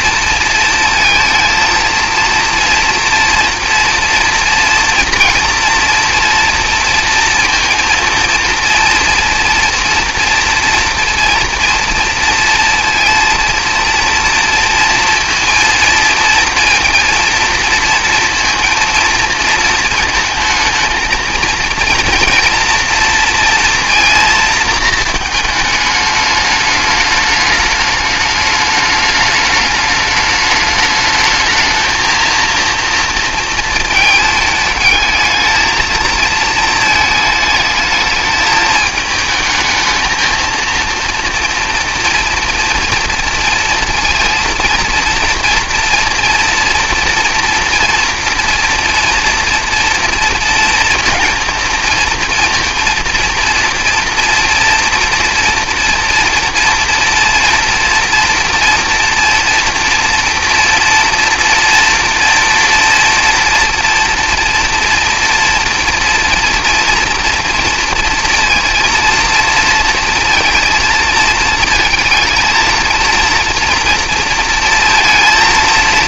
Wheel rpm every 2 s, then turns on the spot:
230, 230, 230, 230, 230, 230, 230, 230, 230, 230, 220, 240, 230, 210, 210, 210, 230, 220, 220, 220, 230, 230, 230, 230, 230, 230, 230, 230, 240, 230, 240, 230, 230, 230, 230, 230, 230, 230.
none